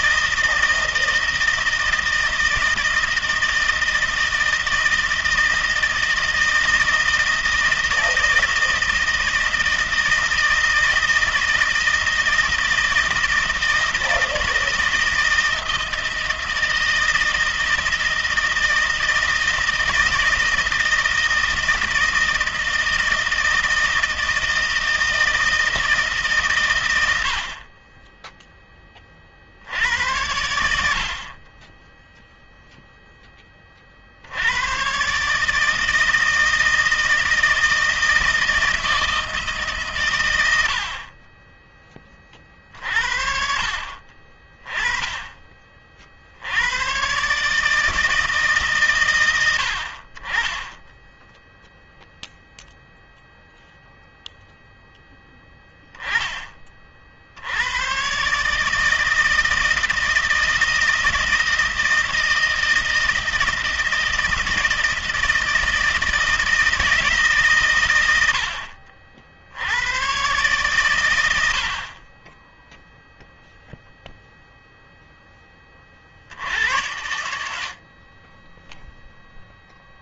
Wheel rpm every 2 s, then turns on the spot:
160, 160, 160, 160, 160, 160, 160, 160, 160, 160, 160, 160, 160, 130, 10, 90, 0, 90, 160, 160, 90, 40, 30, 80, 150, 20, 0, 0, 20, 150, 160, 160, 160, 160, 80, 120, 10, 0, 70, 20.
none